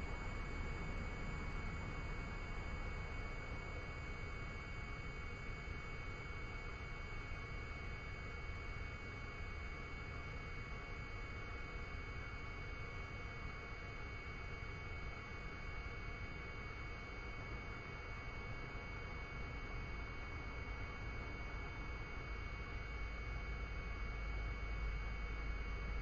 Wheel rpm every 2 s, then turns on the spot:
0, 0, 0, 0, 0, 0, 0, 0, 0, 0, 0, 0, 0.
none